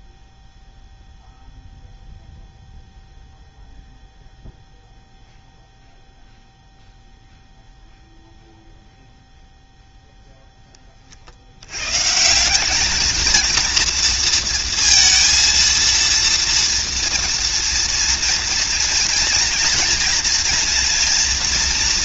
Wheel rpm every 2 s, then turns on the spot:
0, 0, 0, 0, 0, 10, 190, 230, 230, 230, 230.
none